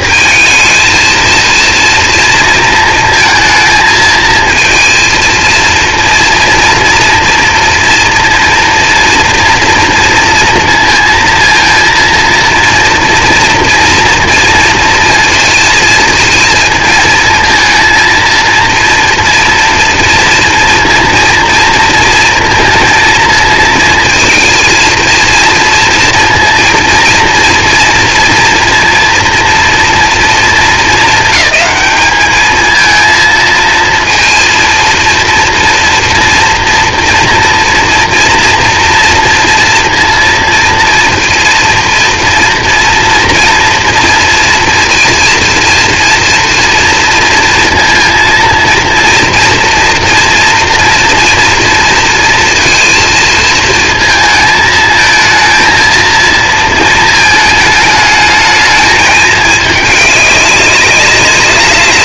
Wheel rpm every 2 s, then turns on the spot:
220, 230, 230, 230, 230, 230, 230, 230, 230, 230, 230, 230, 230, 230, 230, 220, 210, 230, 230, 230, 230, 230, 240, 240, 230, 230, 230, 220, 230, 210, 200.
none